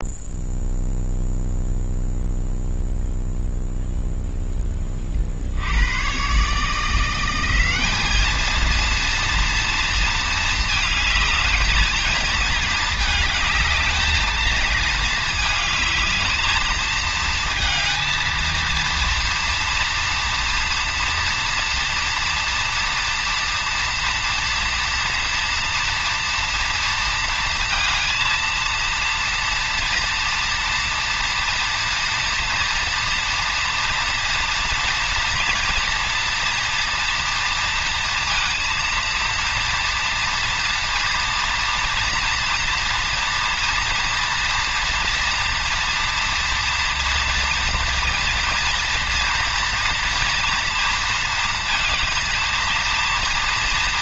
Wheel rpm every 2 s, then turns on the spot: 0, 0, 10, 150, 230, 220, 220, 220, 220, 230, 230, 230, 230, 230, 230, 230, 240, 230, 230, 230, 230, 230, 230, 230, 230, 230, 230.
none